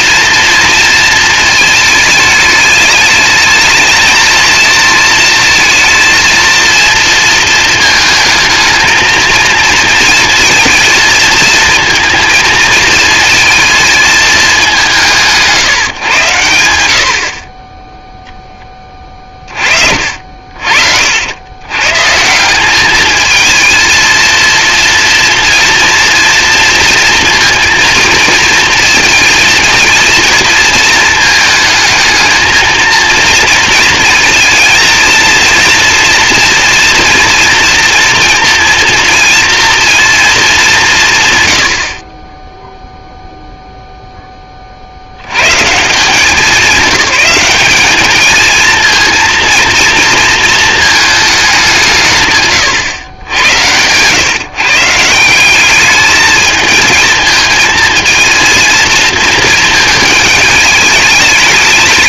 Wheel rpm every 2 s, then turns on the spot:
230, 210, 220, 230, 220, 230, 220, 190, 90, 10, 60, 190, 230, 230, 230, 230, 230, 230, 230, 230, 190, 0, 30, 200, 220, 230, 140, 140, 220, 230, 210.
52-54